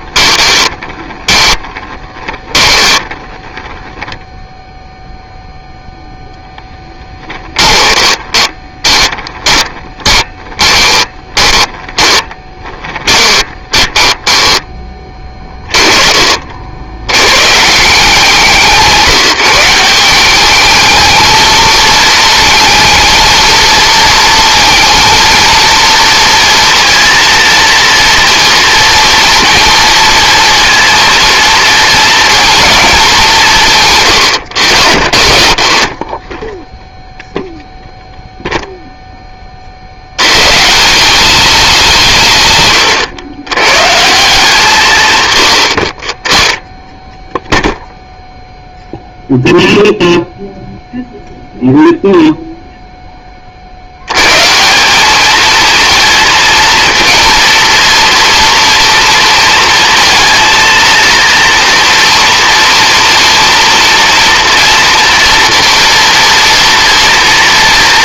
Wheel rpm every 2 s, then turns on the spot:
20, 10, 0, 10, 20, 20, 20, 20, 60, 170, 210, 220, 230, 230, 230, 230, 220, 70, 0, 0, 170, 120, 150, 20, 0, 0, 0, 180, 230, 230, 230, 230, 230, 230.
0-4 6-14